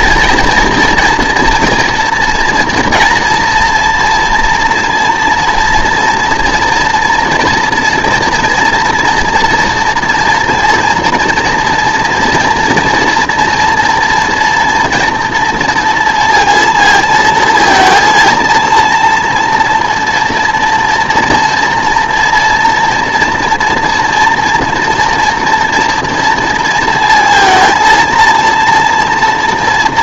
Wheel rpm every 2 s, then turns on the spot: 230, 230, 230, 240, 230, 230, 240, 240, 230, 230, 230, 230, 230, 230, 230.
none